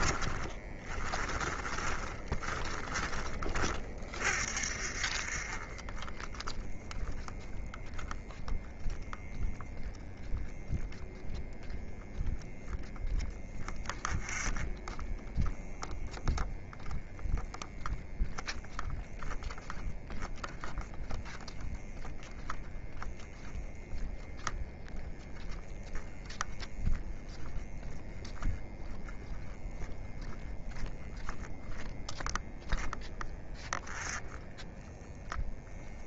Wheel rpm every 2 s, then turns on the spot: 20, 20, 20, 0, 0, 0, 10, 10, 0, 0, 0, 0, 0, 0, 0, 0, 0, 0.
0-4